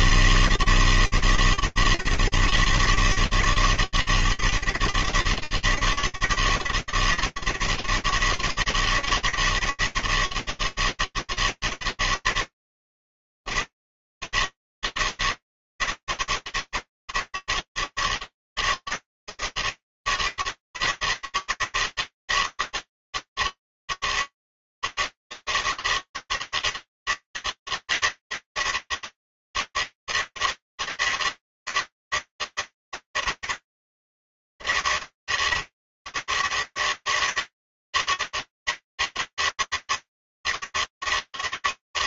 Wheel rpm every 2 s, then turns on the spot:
160, 140, 140, 160, 160, 160, 160, 160, 160, 150, 160, 160, 140, 160, 160, 160, 160, 150, 140, 160, 160.
none